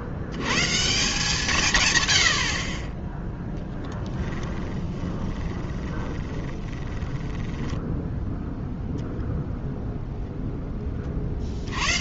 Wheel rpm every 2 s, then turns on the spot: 110, 60, 20, 20, 0, 10.
4-8